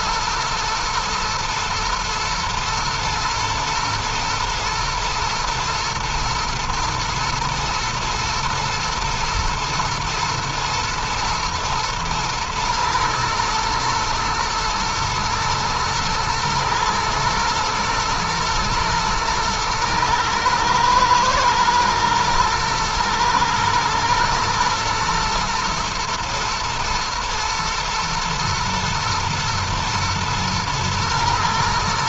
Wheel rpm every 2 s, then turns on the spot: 110, 110, 120, 120, 120, 110, 110, 110, 110, 120, 120, 110, 120, 120, 110, 110.
none